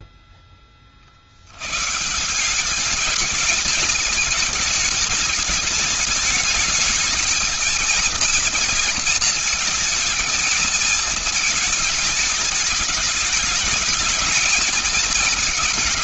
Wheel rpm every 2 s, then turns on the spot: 10, 190, 210, 210, 230, 230, 220, 220.
none